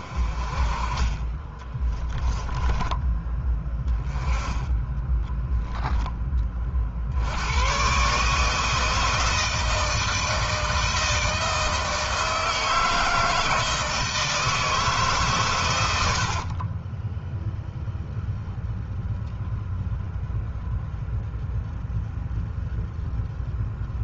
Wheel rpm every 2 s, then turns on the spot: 30, 20, 10, 70, 160, 160, 160, 140, 10, 0, 0, 0.
2-6 16-18